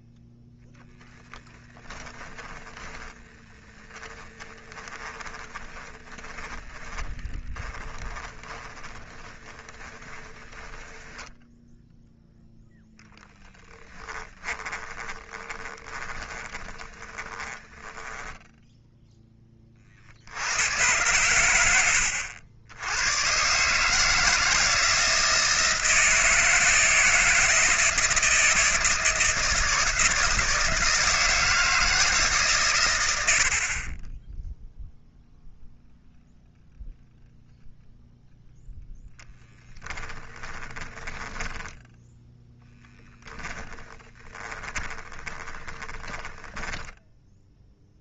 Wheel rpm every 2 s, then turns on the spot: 0, 10, 20, 20, 20, 10, 20, 20, 20, 10, 90, 90, 160, 160, 160, 160, 120, 0, 0, 0, 10, 10, 20, 10.
2-18 40-42 44-48